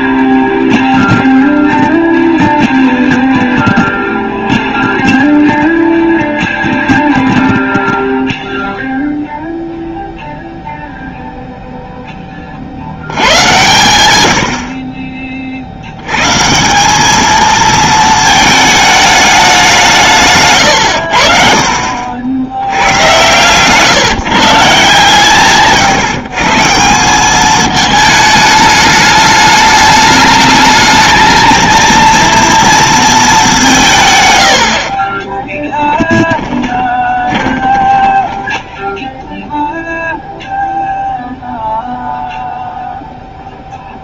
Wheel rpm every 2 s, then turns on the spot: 0, 0, 0, 0, 0, 0, 70, 40, 190, 220, 110, 100, 150, 170, 210, 220, 230, 70, 20, 20, 0, 0.
34-40